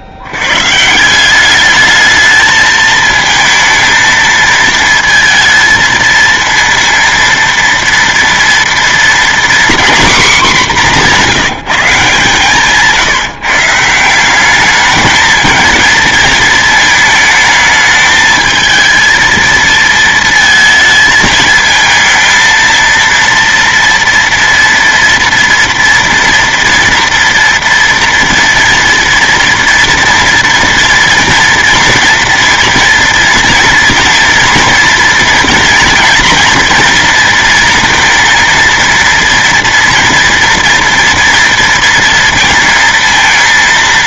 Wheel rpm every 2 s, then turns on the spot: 70, 220, 220, 230, 230, 220, 160, 200, 220, 220, 220, 230, 230, 240, 230, 230, 230, 230, 230, 230, 230, 230.
12-14